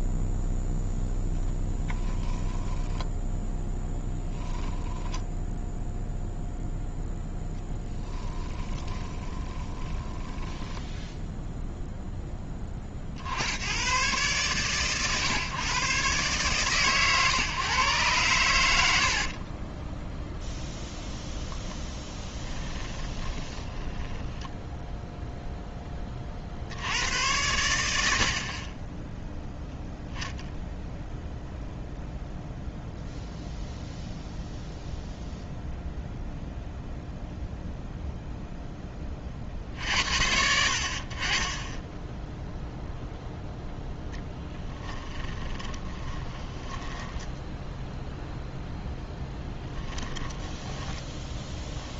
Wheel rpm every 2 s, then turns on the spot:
0, 10, 10, 0, 30, 10, 40, 120, 130, 80, 0, 20, 0, 70, 10, 0, 0, 0, 0, 10, 50, 0, 20, 20, 0, 20.
4-6 8-12 22-24 44-48 50-52